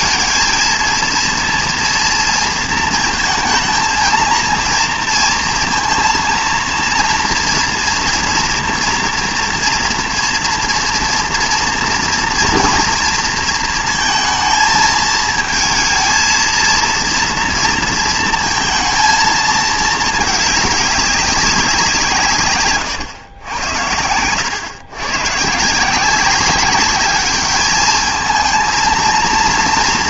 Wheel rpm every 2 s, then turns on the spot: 230, 230, 230, 230, 230, 240, 230, 220, 230, 230, 210, 140, 110, 200, 230.
none